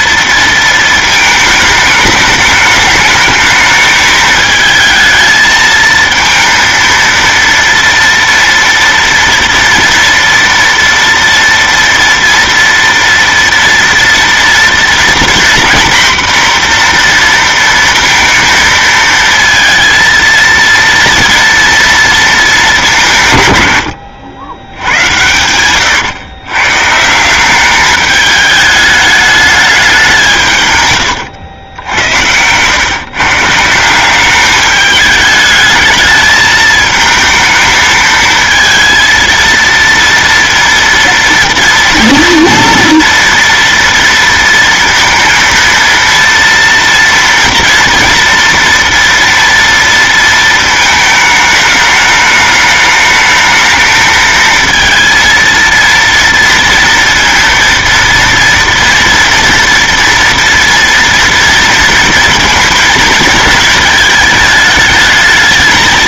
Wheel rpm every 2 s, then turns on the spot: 230, 210, 220, 230, 240, 230, 230, 230, 240, 230, 230, 200, 90, 140, 210, 140, 120, 210, 220, 230, 230, 230, 230, 240, 230, 220, 210, 230, 230, 230, 230, 230, 220.
none